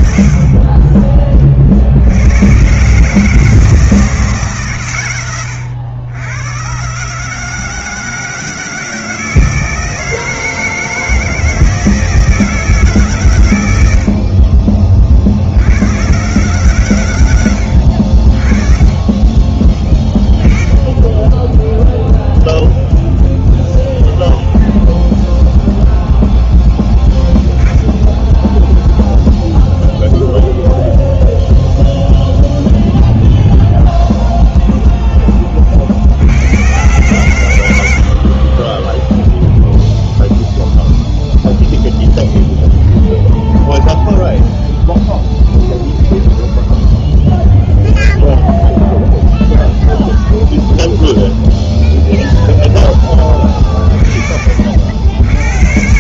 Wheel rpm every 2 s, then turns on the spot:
20, 150, 140, 140, 160, 160, 150, 40, 120, 30, 10, 0, 0, 0, 0, 0, 0, 0, 90, 30, 0, 0, 0, 0, 0, 0, 0, 50.
18-20 38-40